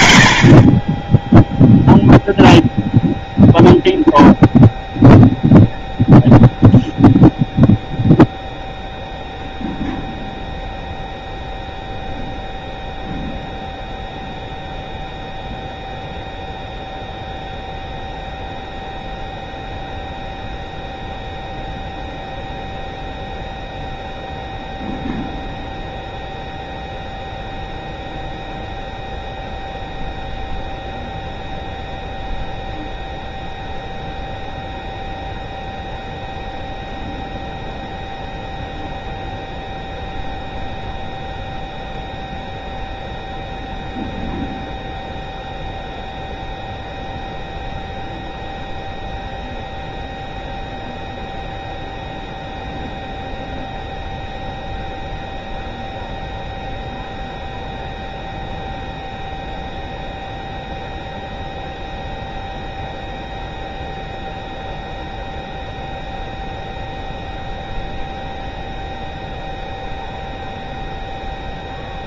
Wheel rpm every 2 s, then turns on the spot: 0, 0, 0, 0, 0, 0, 0, 0, 0, 0, 0, 0, 0, 0, 0, 0, 0, 0, 0, 0, 0, 0, 0, 0, 0, 0, 0, 0, 0, 0, 0, 0, 0, 0, 0, 0.
none